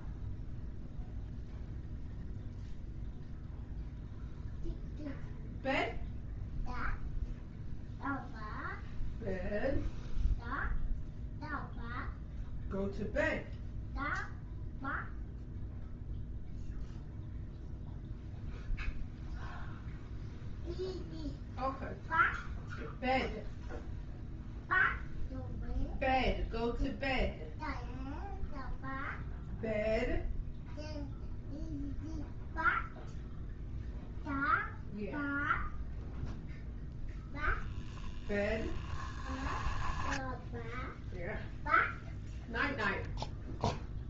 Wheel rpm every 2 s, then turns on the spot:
0, 0, 0, 0, 0, 0, 0, 0, 0, 0, 0, 0, 0, 0, 0, 0, 0, 0, 0, 10, 0, 0.
38-40